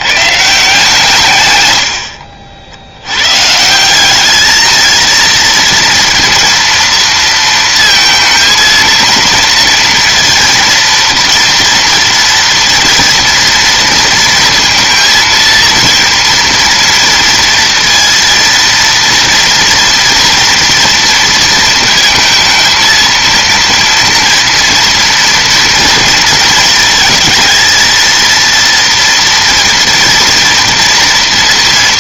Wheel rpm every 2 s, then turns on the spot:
160, 70, 220, 230, 230, 230, 230, 230, 230, 230, 230, 230, 230, 230, 230, 230.
none